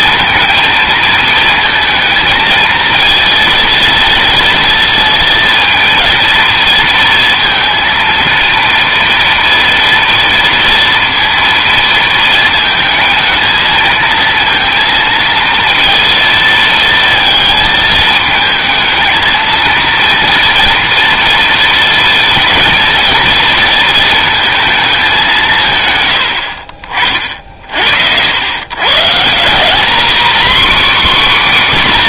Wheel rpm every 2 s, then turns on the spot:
230, 220, 230, 230, 230, 230, 220, 230, 230, 220, 230, 230, 220, 60, 130, 270.
none